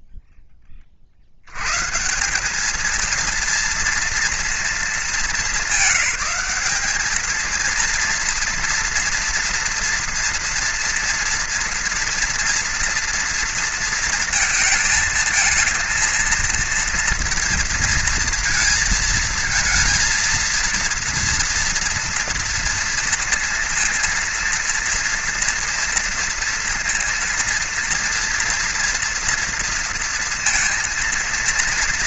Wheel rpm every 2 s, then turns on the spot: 20, 220, 220, 200, 230, 230, 230, 220, 230, 220, 230, 230, 230, 230, 230, 230.
none